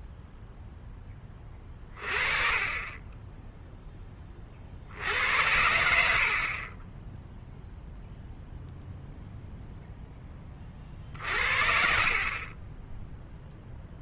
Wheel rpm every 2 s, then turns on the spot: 10, 30, 60, 30, 0, 40, 20.
none